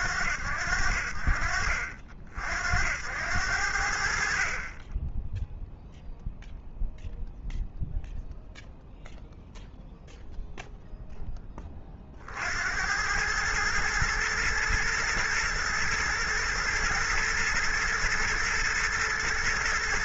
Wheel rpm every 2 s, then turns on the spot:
50, 50, 0, 0, 0, 50, 110, 110, 120, 110.
none